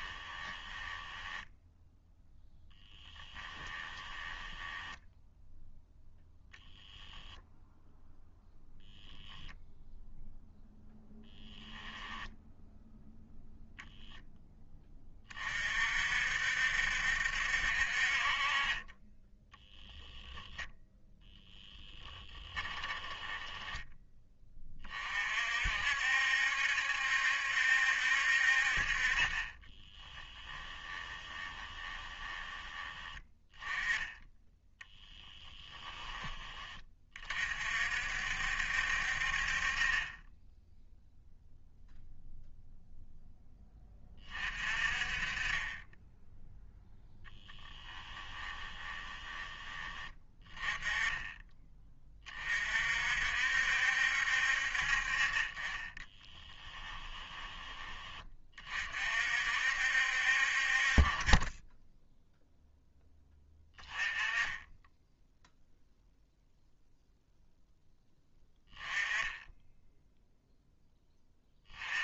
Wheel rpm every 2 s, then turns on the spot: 10, 0, 10, 0, 0, 0, 0, 10, 60, 40, 0, 10, 20, 70, 50, 20, 20, 10, 20, 60, 0, 0, 40, 0, 20, 20, 40, 60, 10, 30, 40, 0, 10, 0, 10, 0.
0-2 4-6 22-24 30-32 48-50 56-58